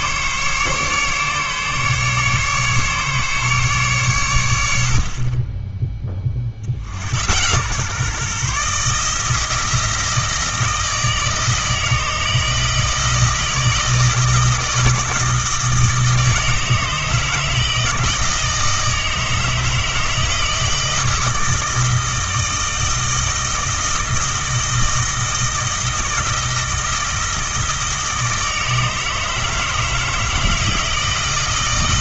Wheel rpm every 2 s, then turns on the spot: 140, 140, 100, 40, 150, 160, 160, 160, 160, 160, 160, 160, 160, 160, 160, 160.
none